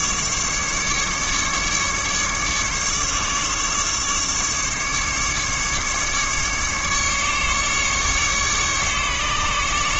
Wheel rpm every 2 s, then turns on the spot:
150, 150, 150, 150, 140.
none